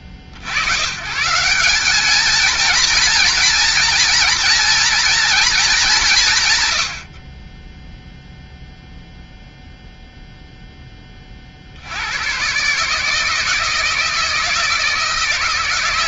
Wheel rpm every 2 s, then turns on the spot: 70, 220, 230, 120, 0, 0, 130, 160.
none